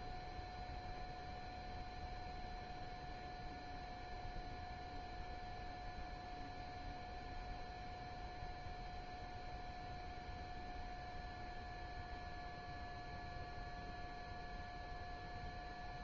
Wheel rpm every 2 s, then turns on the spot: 0, 0, 0, 0, 0, 0, 0, 0.
none